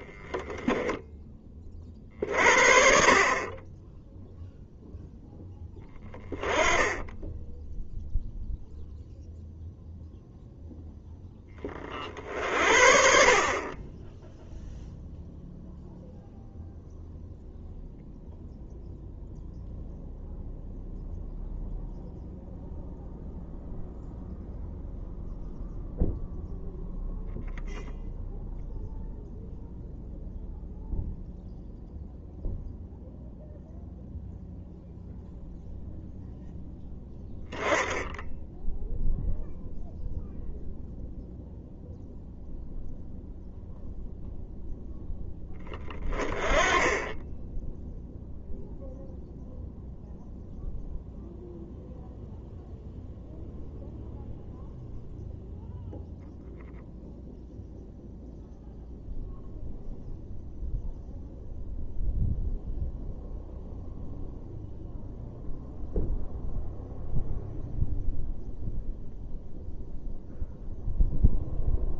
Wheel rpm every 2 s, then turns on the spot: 0, 40, 0, 10, 0, 0, 60, 0, 0, 0, 0, 0, 0, 0, 0, 0, 0, 0, 0, 0, 0, 0, 0, 20, 0, 0, 0, 0, 0, 0, 0, 0, 0, 0, 0, 0.
none